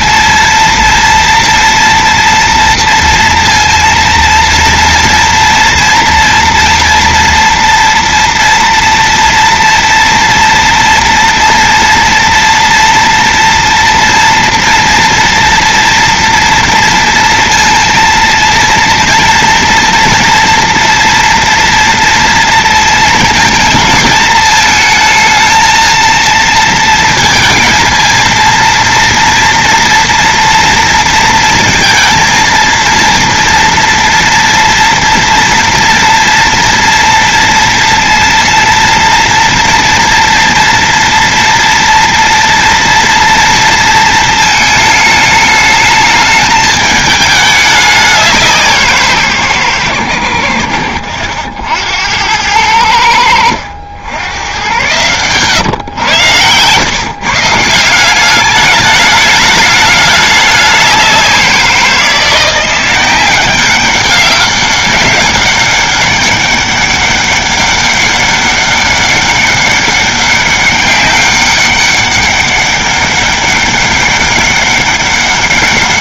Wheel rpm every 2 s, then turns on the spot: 230, 230, 230, 230, 230, 230, 230, 230, 230, 230, 230, 230, 220, 230, 230, 230, 230, 240, 240, 230, 230, 230, 220, 220, 190, 90, 90, 110, 110, 190, 210, 170, 200, 200, 200, 200, 200, 200.
none